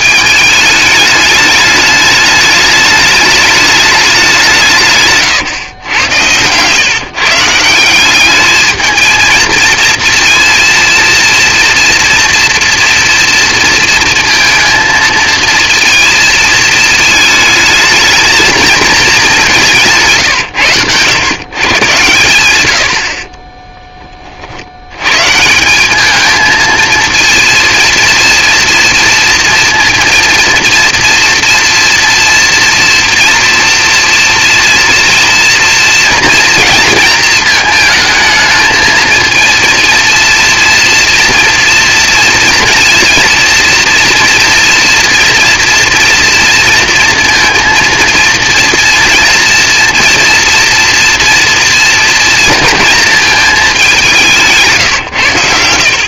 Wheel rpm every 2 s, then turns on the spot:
210, 210, 130, 140, 220, 230, 230, 230, 220, 200, 120, 40, 130, 230, 230, 230, 230, 230, 220, 230, 230, 230, 240, 230, 230, 230, 220, 120.
22-24 54-56